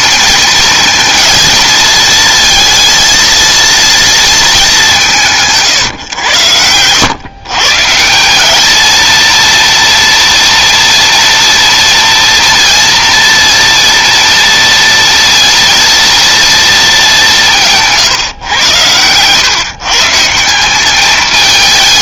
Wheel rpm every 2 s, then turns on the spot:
230, 230, 200, 100, 220, 230, 230, 230, 220, 110, 180.
none